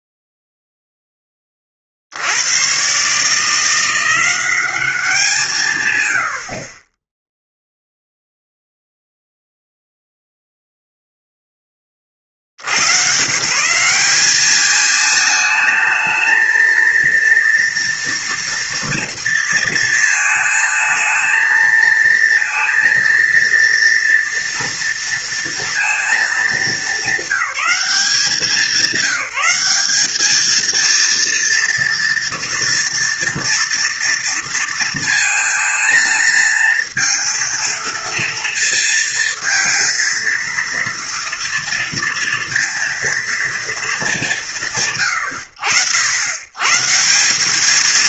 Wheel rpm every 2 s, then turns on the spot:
0, 90, 190, 60, 0, 0, 70, 200, 220, 230, 220, 230, 230, 220, 190, 220, 230, 230, 220, 230, 230, 230, 210, 120.
none